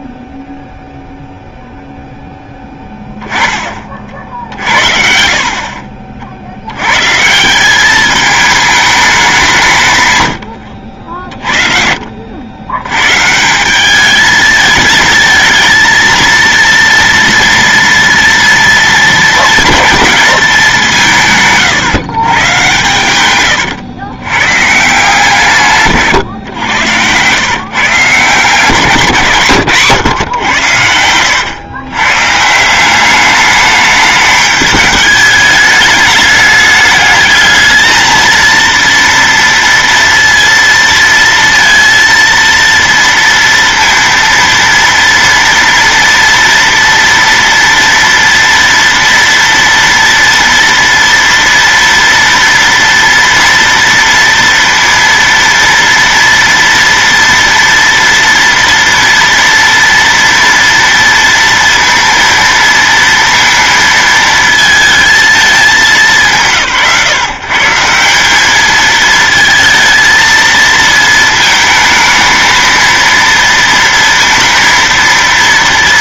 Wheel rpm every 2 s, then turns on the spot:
0, 10, 60, 60, 210, 90, 90, 220, 230, 220, 190, 130, 140, 110, 160, 120, 170, 210, 210, 230, 230, 230, 230, 230, 230, 230, 230, 230, 230, 230, 230, 230, 220, 160, 210, 230, 220, 230.
none